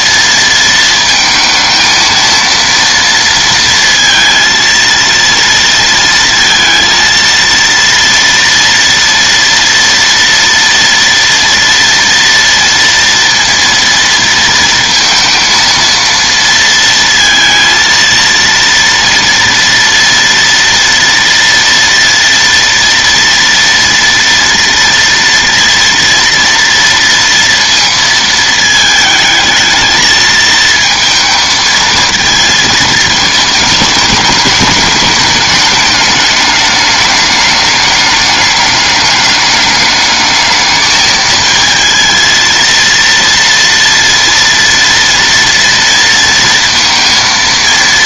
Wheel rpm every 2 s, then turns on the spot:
230, 230, 230, 230, 230, 230, 230, 230, 230, 230, 230, 230, 230, 230, 220, 220, 220, 210, 210, 210, 220, 230, 230, 230.
none